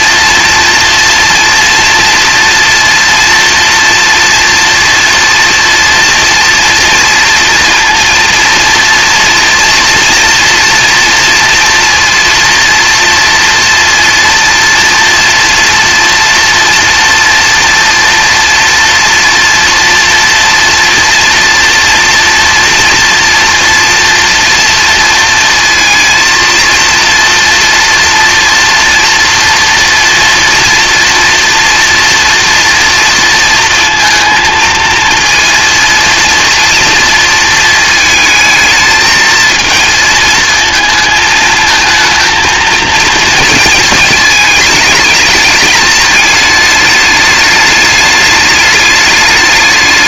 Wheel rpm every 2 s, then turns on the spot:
230, 230, 240, 230, 230, 230, 230, 230, 230, 230, 240, 230, 230, 230, 230, 230, 230, 230, 230, 220, 230, 230, 220, 210, 210.
none